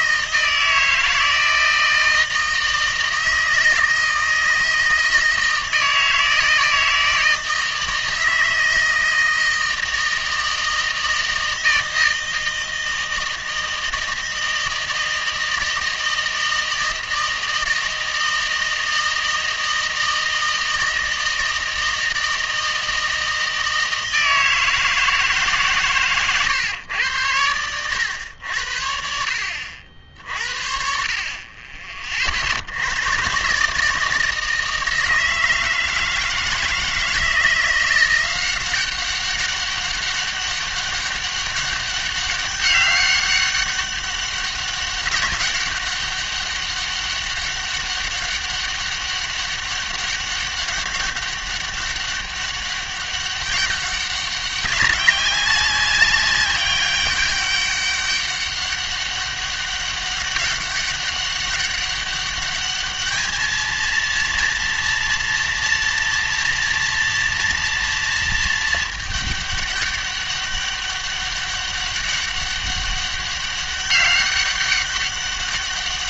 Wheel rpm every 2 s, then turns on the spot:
160, 160, 160, 160, 160, 160, 160, 160, 160, 160, 160, 160, 160, 110, 70, 50, 80, 160, 160, 190, 200, 200, 200, 200, 200, 200, 200, 200, 200, 200, 200, 210, 230, 230, 220, 200, 200, 200.
none